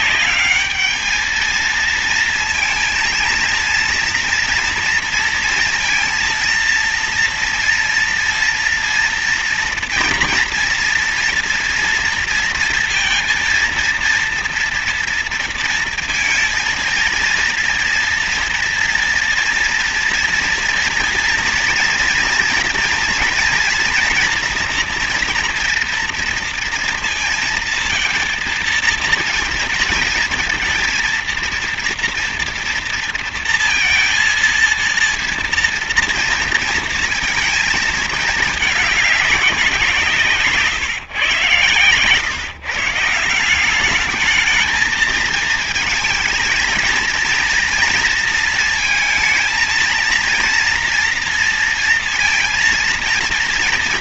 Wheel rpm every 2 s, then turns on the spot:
220, 230, 230, 230, 230, 230, 230, 240, 230, 230, 230, 230, 230, 230, 220, 230, 230, 230, 230, 220, 160, 150, 220, 230, 230, 230, 230.
none